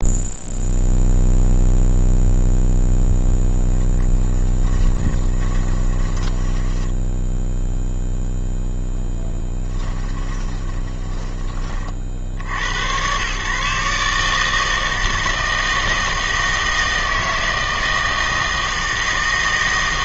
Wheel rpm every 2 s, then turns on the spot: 0, 0, 10, 10, 0, 10, 80, 160, 160, 160.
4-8 10-12